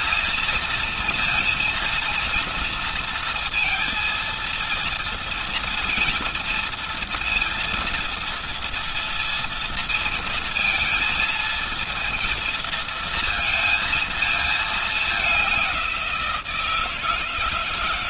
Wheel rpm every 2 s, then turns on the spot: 230, 230, 230, 230, 230, 230, 230, 220, 170.
none